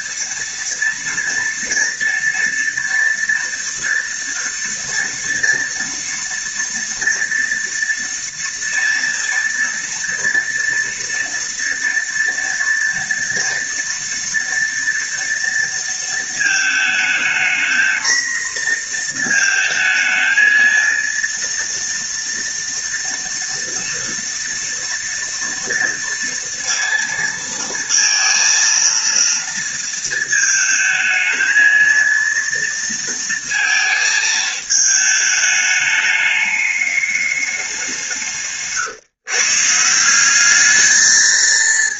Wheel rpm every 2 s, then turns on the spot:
230, 230, 230, 230, 230, 230, 230, 230, 220, 230, 220, 230, 230, 230, 230, 220, 230, 220, 210, 160, 210.
38-40